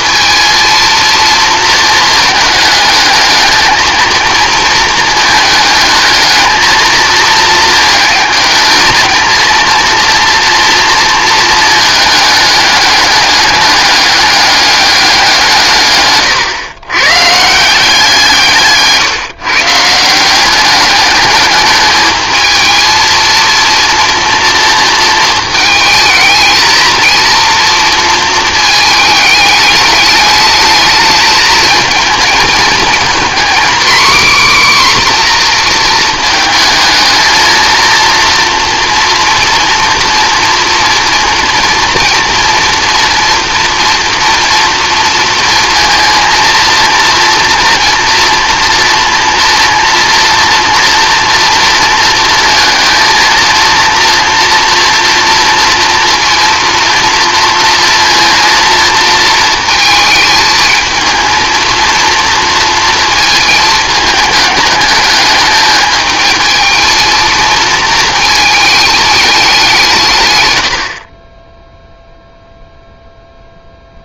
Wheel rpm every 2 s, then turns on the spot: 230, 210, 230, 220, 220, 230, 210, 200, 120, 160, 200, 220, 230, 230, 220, 210, 230, 270, 220, 230, 230, 230, 230, 230, 230, 230, 220, 230, 230, 230, 220, 230, 210, 220, 220, 80, 0.
18-20